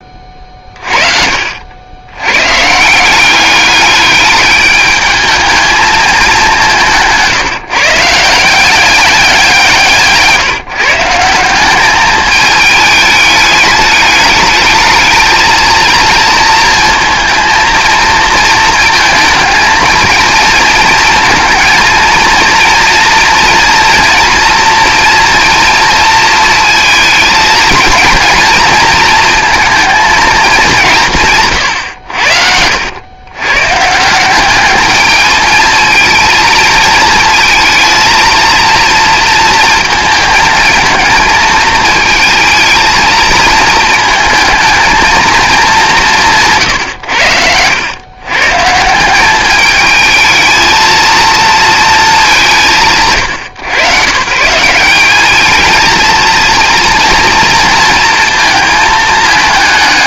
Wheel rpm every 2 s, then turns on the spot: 40, 160, 210, 180, 190, 160, 210, 220, 230, 230, 220, 240, 240, 230, 240, 170, 90, 210, 220, 230, 220, 220, 230, 120, 170, 230, 160, 190, 230, 220.
none